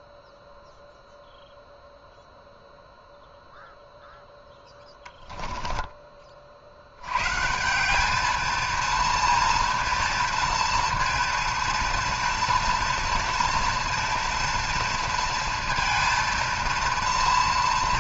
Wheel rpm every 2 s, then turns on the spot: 0, 0, 10, 60, 220, 230, 230, 230, 230.
4-6